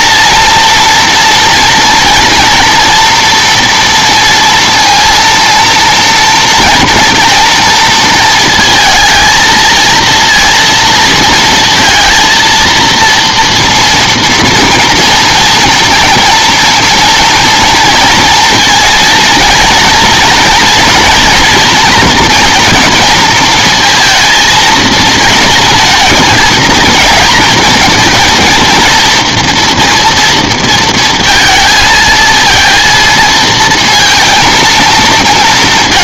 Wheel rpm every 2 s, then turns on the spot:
230, 230, 230, 230, 230, 230, 230, 230, 230, 230, 240, 240, 220, 220, 230, 230, 230, 230.
none